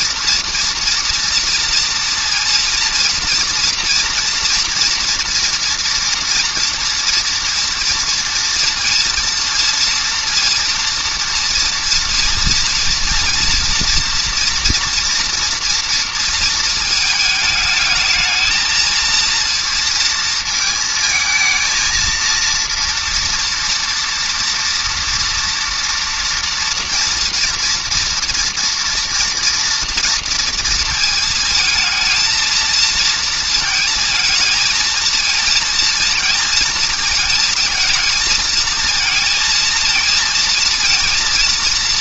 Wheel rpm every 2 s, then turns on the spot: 230, 230, 230, 240, 230, 230, 230, 230, 230, 210, 230, 220, 230, 230, 230, 230, 220, 230, 230, 230, 230.
none